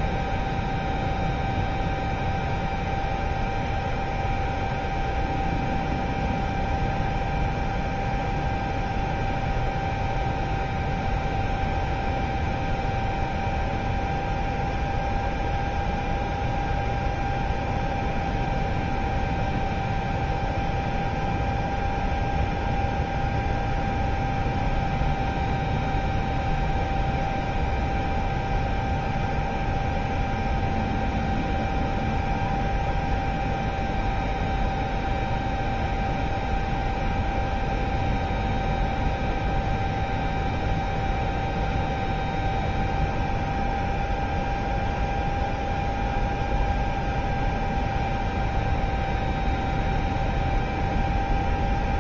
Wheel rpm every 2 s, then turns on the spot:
0, 0, 0, 0, 0, 0, 0, 0, 0, 0, 0, 0, 0, 0, 0, 0, 0, 0, 0, 0, 0, 0, 0, 0, 0, 0.
none